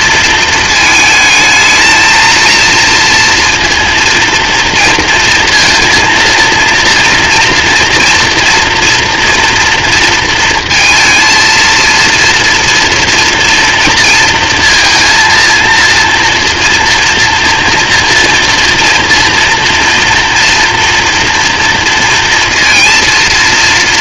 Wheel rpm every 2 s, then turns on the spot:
220, 230, 230, 230, 230, 230, 230, 230, 230, 230, 230, 230.
none